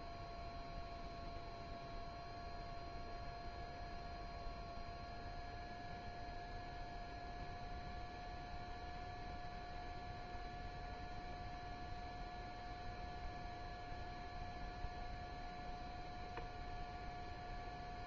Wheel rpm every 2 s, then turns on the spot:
0, 0, 0, 0, 0, 0, 0, 0, 0.
none